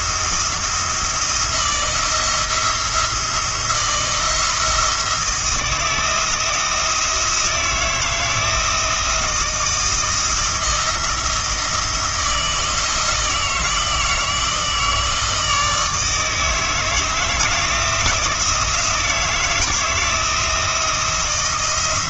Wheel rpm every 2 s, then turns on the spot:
170, 170, 170, 160, 160, 170, 160, 160, 160, 170, 160.
none